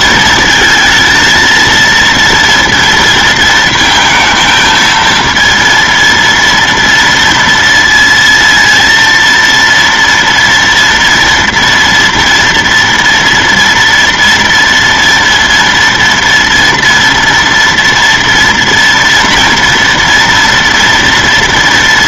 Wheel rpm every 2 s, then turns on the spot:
230, 230, 220, 230, 230, 230, 230, 230, 230, 230, 230.
none